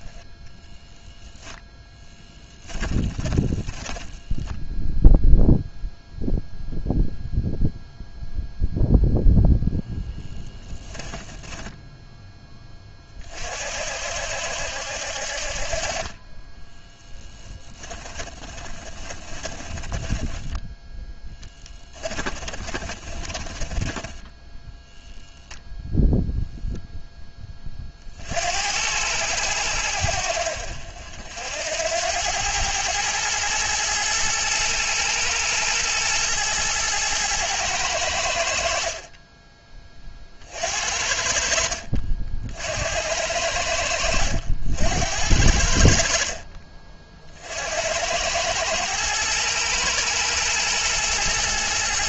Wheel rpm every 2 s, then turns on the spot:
0, 10, 0, 0, 0, 10, 30, 70, 10, 30, 10, 20, 0, 0, 90, 60, 110, 110, 110, 40, 60, 80, 80, 50, 110, 110.
2-4 10-12 16-20 22-24 40-42